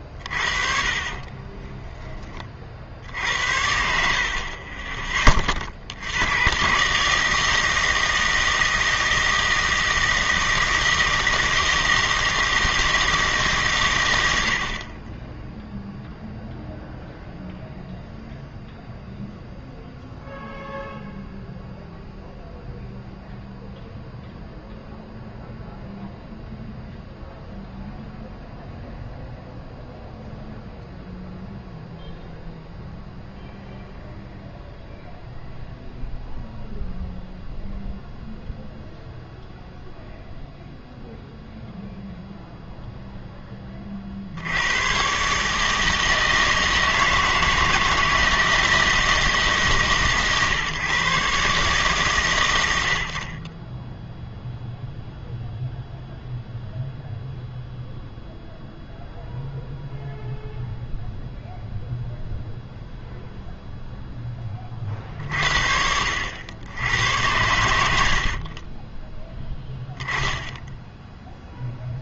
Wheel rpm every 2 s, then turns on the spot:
40, 30, 40, 120, 160, 160, 160, 60, 0, 0, 0, 0, 0, 0, 0, 0, 0, 0, 0, 0, 0, 0, 90, 160, 160, 140, 90, 0, 0, 0, 0, 0, 30, 80, 40, 10.
14-16 68-70